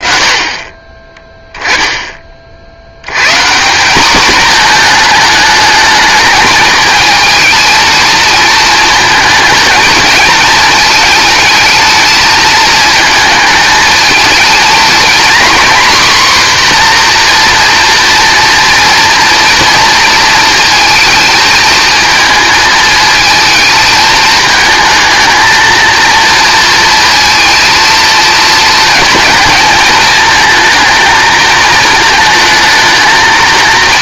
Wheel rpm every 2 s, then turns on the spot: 20, 90, 220, 220, 220, 220, 220, 240, 250, 230, 220, 220, 220, 230, 230, 230, 230.
none